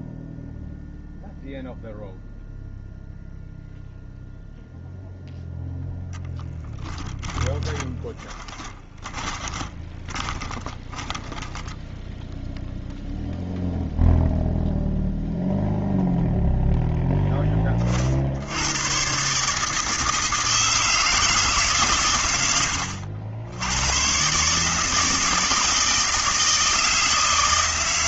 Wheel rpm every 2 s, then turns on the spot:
0, 0, 0, 10, 20, 20, 0, 0, 0, 70, 160, 100, 140, 160.
8-12